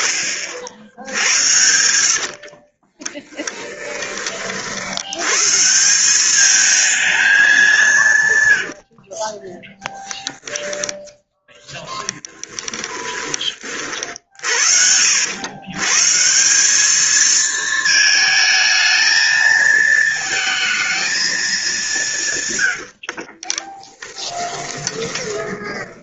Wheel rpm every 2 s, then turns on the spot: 80, 20, 110, 210, 30, 0, 20, 80, 220, 230, 220, 40, 20.
2-4 22-26